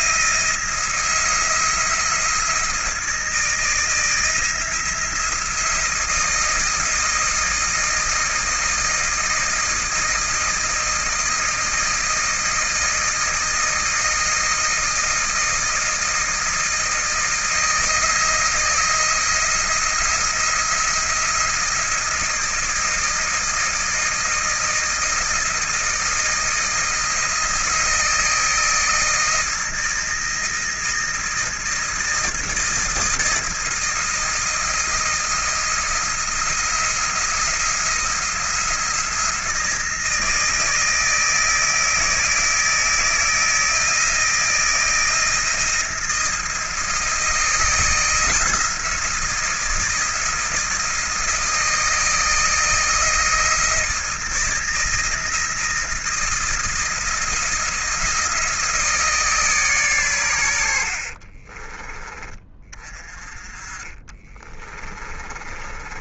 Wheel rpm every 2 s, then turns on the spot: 170, 160, 170, 160, 160, 160, 160, 160, 160, 170, 170, 160, 160, 160, 160, 160, 160, 160, 170, 170, 160, 160, 160, 160, 170, 160, 160, 160, 170, 160, 70, 30, 20.
60-62 64-66